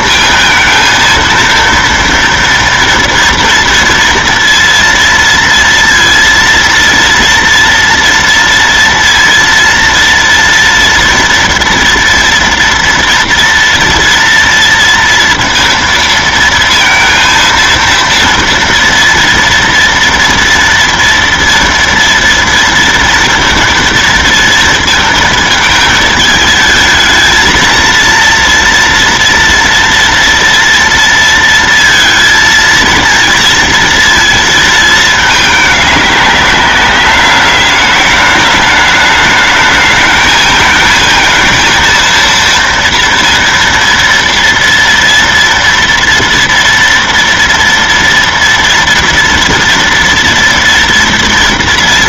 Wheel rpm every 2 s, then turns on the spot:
230, 230, 230, 230, 230, 230, 240, 230, 230, 230, 230, 230, 230, 220, 230, 230, 220, 220, 200, 210, 220, 230, 230, 230, 230, 230.
none